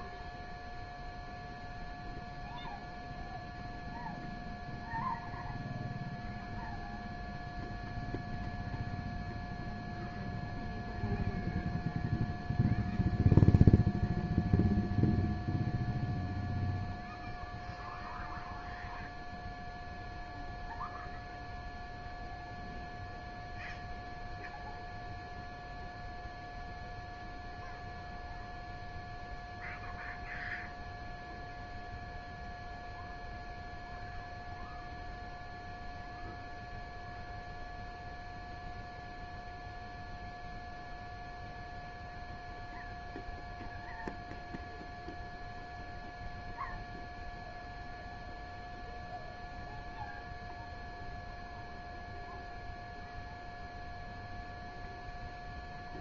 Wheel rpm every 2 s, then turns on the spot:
0, 0, 0, 0, 0, 0, 0, 0, 0, 0, 0, 0, 0, 0, 0, 0, 0, 0, 0, 0, 0, 0, 0, 0, 0, 0, 0, 0.
none